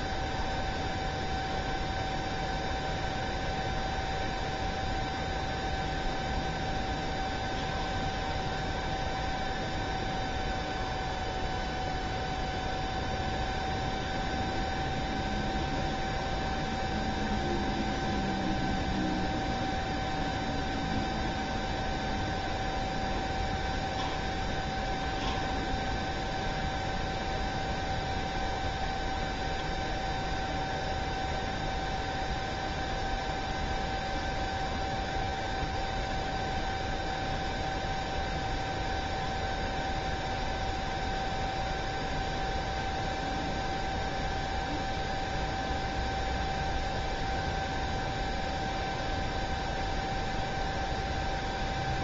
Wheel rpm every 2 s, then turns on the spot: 0, 0, 0, 0, 0, 0, 0, 0, 0, 0, 0, 0, 0, 0, 0, 0, 0, 0, 0, 0, 0, 0, 0, 0, 0, 0.
none